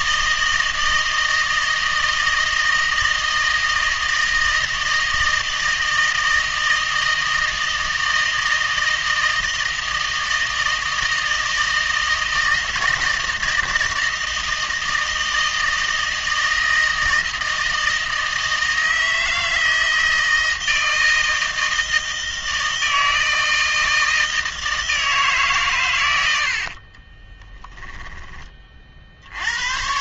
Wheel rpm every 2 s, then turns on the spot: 160, 160, 160, 160, 160, 160, 160, 160, 160, 160, 160, 160, 160, 50, 20.
26-28